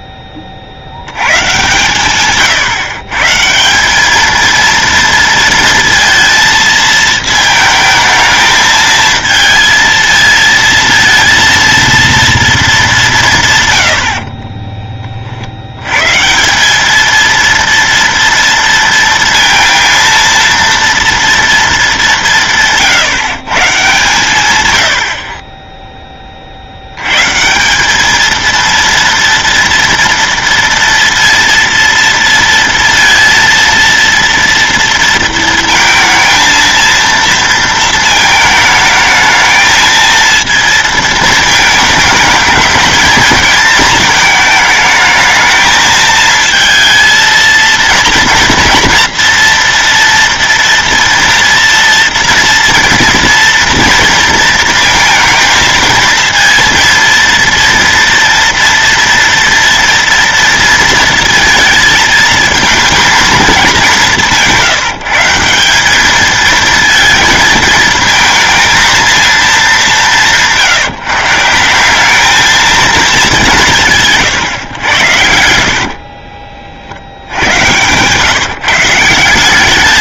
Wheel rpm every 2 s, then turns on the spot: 70, 160, 230, 220, 220, 230, 210, 30, 200, 230, 230, 160, 100, 60, 230, 230, 230, 230, 230, 220, 230, 210, 220, 230, 230, 230, 240, 230, 230, 230, 230, 220, 170, 230, 230, 150, 220, 110, 60, 170.
74-76